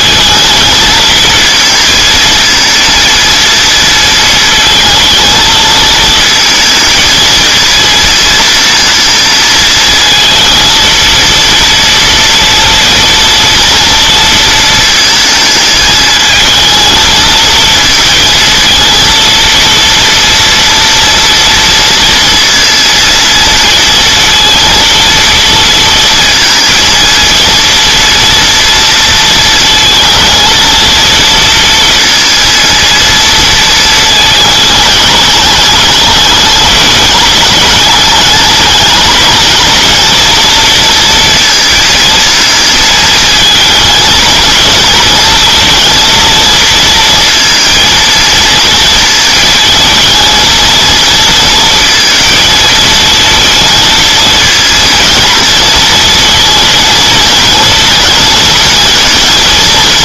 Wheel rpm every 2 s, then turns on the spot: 220, 230, 230, 220, 230, 230, 230, 220, 220, 230, 230, 230, 230, 230, 230, 230, 230, 220, 210, 210, 230, 220, 220, 230, 230, 220, 220, 230, 230, 230.
none